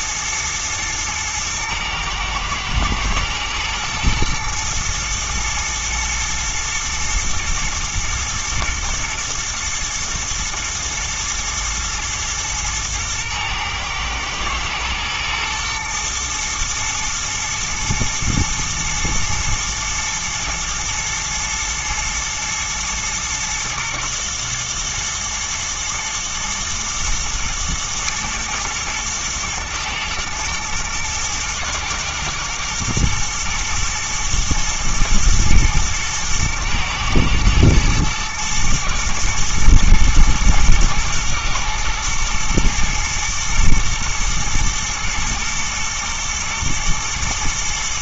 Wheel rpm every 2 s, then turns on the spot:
120, 110, 120, 110, 110, 120, 110, 110, 110, 110, 120, 120, 110, 110, 110, 110, 110, 110, 110, 110, 110, 110, 110, 110.
none